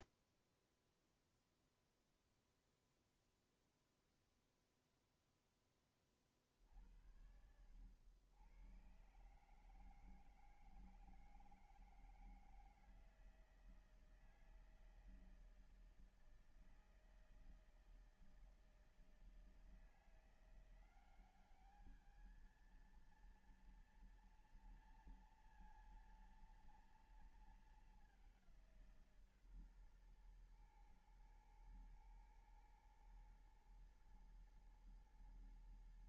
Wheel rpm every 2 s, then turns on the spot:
0, 0, 0, 30, 90, 160, 160, 160, 160, 160, 170, 210, 230, 230, 200, 130, 110, 110.
none